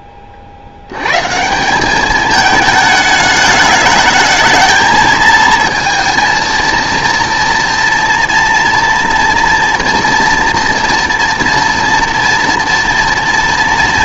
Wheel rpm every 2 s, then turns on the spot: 80, 210, 220, 230, 230, 230, 230.
none